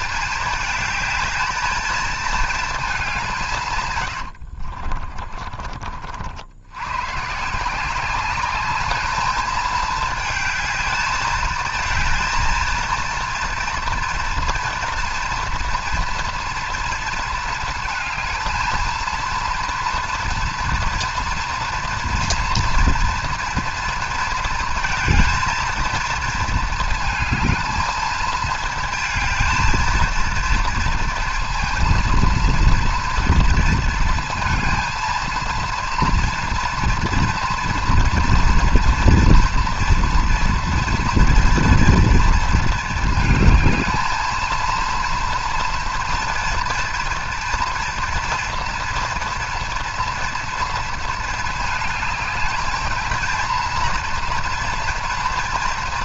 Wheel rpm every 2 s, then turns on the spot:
220, 220, 70, 100, 210, 220, 230, 230, 230, 220, 230, 230, 220, 220, 230, 230, 230, 230, 230, 240, 230, 230, 230, 230, 230, 230, 220, 230.
4-6